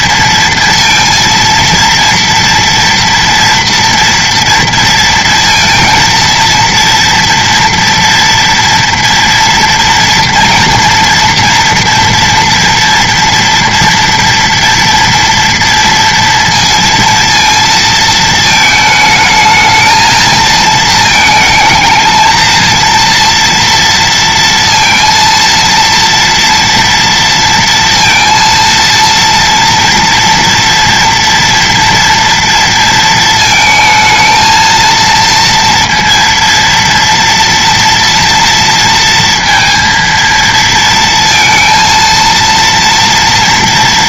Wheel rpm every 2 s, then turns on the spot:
230, 230, 230, 230, 230, 230, 240, 230, 230, 220, 220, 230, 230, 230, 230, 230, 230, 230, 230, 230, 230, 230.
none